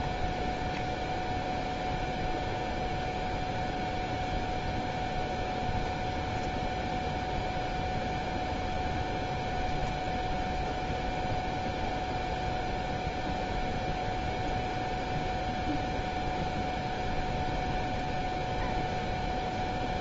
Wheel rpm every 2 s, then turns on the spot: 0, 0, 0, 0, 0, 0, 0, 0, 0, 0.
none